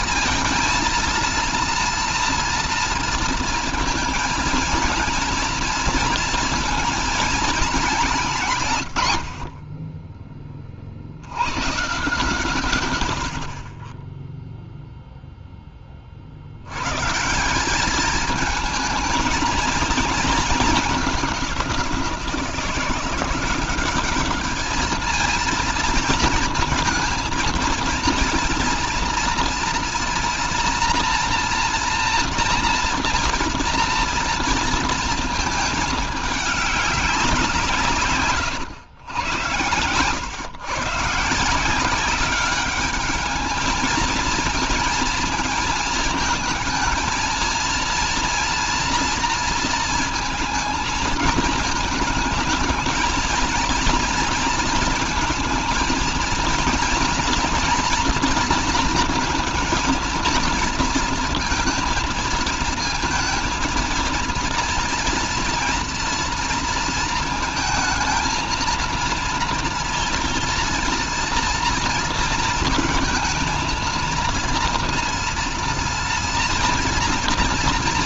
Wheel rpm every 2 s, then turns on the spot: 230, 230, 220, 220, 140, 50, 100, 0, 110, 220, 200, 170, 220, 220, 230, 230, 240, 230, 200, 120, 150, 210, 230, 220, 230, 230, 220, 230, 230, 230, 230, 230, 230, 230, 230, 240, 230, 230, 240.
none